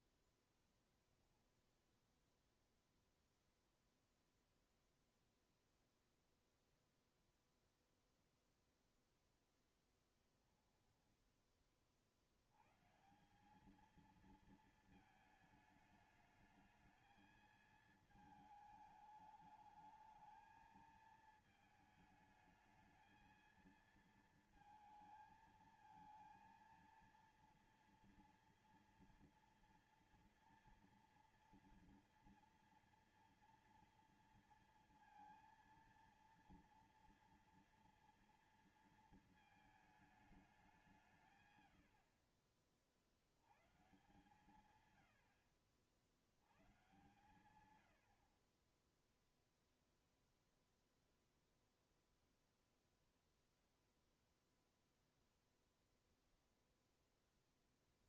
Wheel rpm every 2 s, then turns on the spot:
20, 0, 0, 0, 0, 0, 60, 220, 210, 220, 220, 220, 220, 230, 230, 230, 240, 230, 230, 230, 210, 60, 140, 80, 50, 0, 0, 0, 0.
none